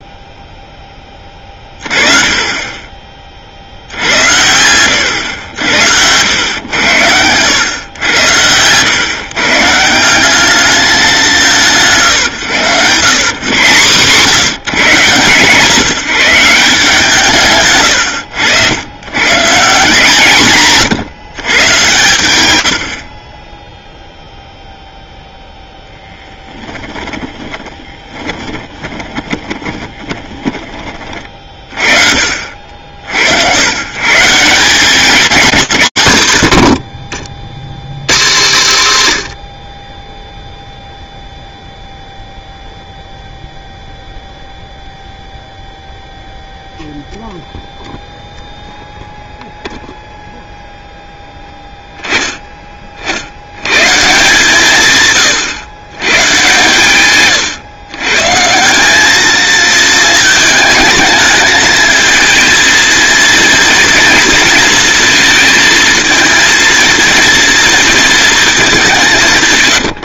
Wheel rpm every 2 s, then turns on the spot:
10, 30, 100, 90, 130, 210, 130, 140, 170, 110, 140, 60, 0, 10, 20, 30, 70, 200, 60, 120, 0, 0, 0, 0, 0, 0, 40, 140, 130, 200, 220, 230, 230, 230, 170.
22-24 26-30